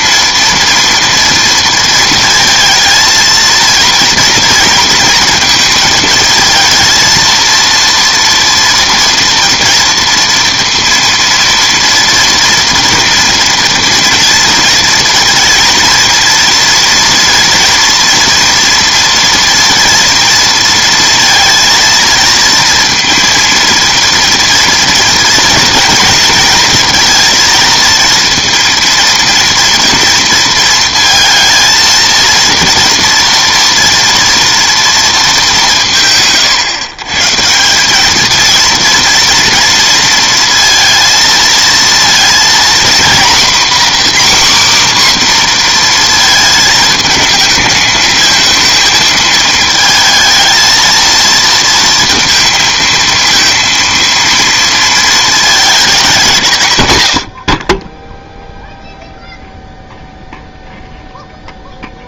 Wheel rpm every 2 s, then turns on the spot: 240, 230, 230, 230, 230, 230, 230, 230, 230, 230, 230, 230, 230, 230, 230, 230, 230, 230, 140, 230, 230, 230, 270, 220, 220, 230, 230, 230, 130, 0, 0.
none